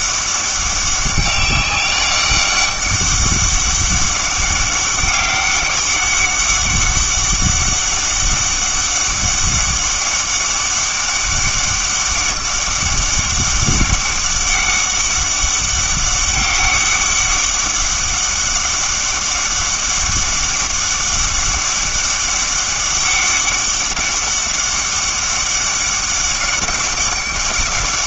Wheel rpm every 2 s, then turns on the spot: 200, 200, 200, 200, 200, 200, 200, 200, 200, 200, 200, 200, 200, 200.
none